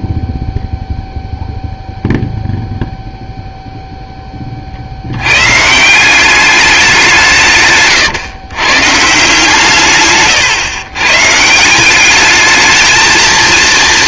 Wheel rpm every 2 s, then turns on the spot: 0, 0, 80, 190, 150, 130, 220.
none